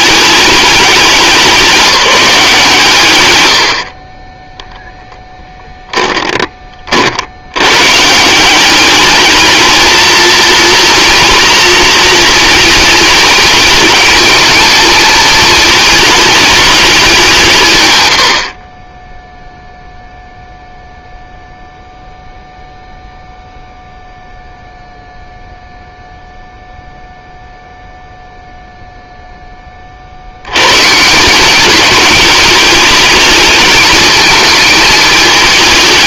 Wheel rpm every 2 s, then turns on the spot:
200, 170, 0, 30, 190, 230, 220, 220, 210, 50, 0, 0, 0, 0, 0, 110, 220, 220.
none